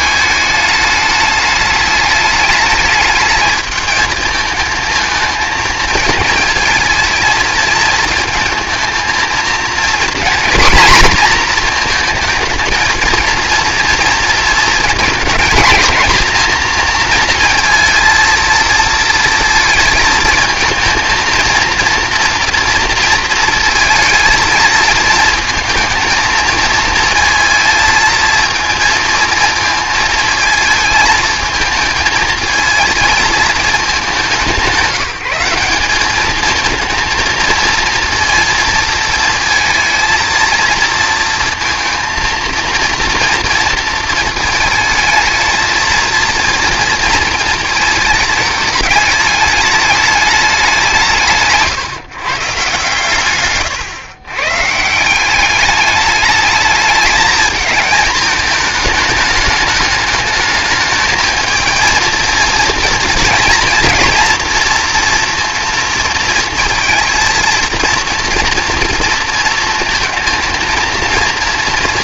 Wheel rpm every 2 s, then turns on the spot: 210, 220, 220, 230, 230, 250, 230, 230, 230, 230, 220, 230, 230, 230, 230, 220, 220, 190, 230, 230, 230, 230, 220, 230, 210, 170, 130, 160, 210, 220, 220, 230, 230, 220, 230, 230.
none